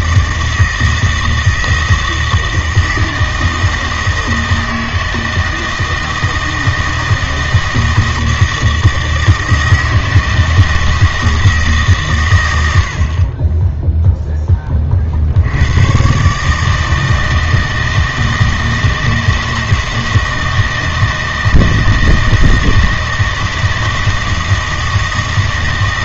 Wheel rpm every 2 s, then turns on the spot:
160, 160, 160, 160, 160, 160, 80, 20, 150, 160, 160, 160, 160.
none